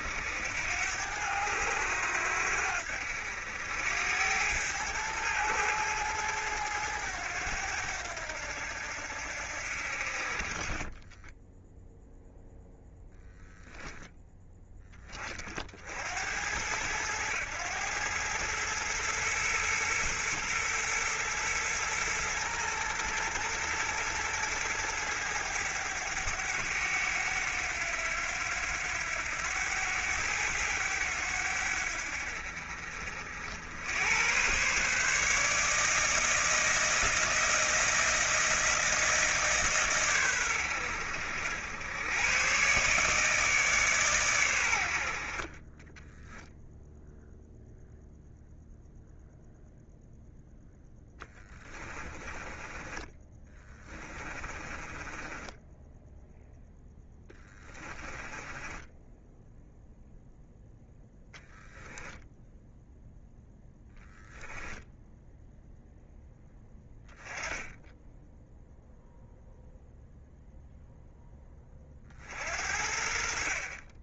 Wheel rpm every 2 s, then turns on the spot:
90, 80, 110, 100, 80, 20, 0, 20, 100, 110, 110, 110, 110, 100, 90, 90, 70, 140, 160, 160, 90, 140, 70, 0, 0, 10, 20, 20, 10, 10, 10, 0, 0, 10, 0, 0, 50.
10-12 52-56 58-62